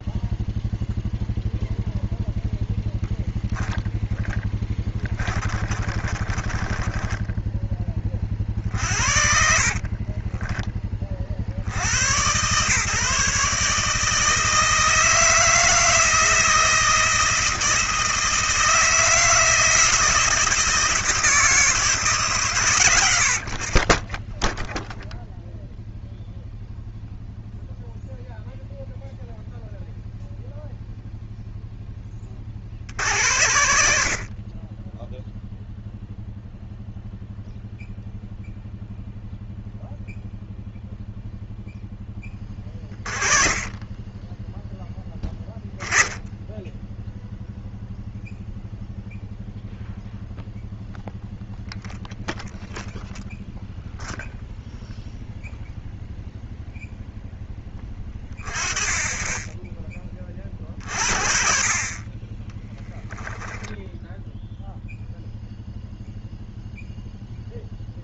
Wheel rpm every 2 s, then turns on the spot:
0, 0, 20, 20, 50, 20, 130, 160, 160, 160, 160, 130, 0, 0, 0, 0, 60, 20, 0, 0, 0, 30, 10, 10, 0, 0, 0, 0, 0, 20, 40, 10, 0, 0.
4-12